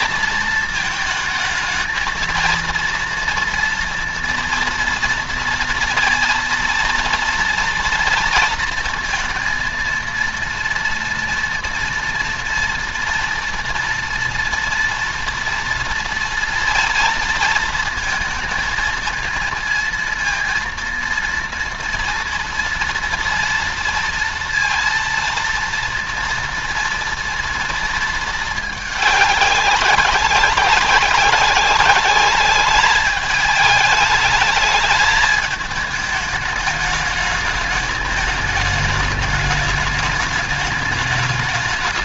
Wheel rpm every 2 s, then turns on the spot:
220, 230, 230, 230, 230, 230, 230, 230, 230, 220, 230, 230, 230, 230, 220, 190, 210, 210, 210, 210, 210.
none